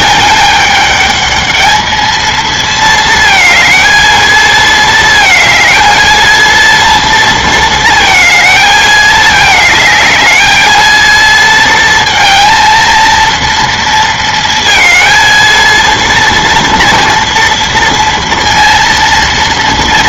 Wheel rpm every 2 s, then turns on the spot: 210, 220, 220, 230, 220, 220, 230, 230, 230, 230.
none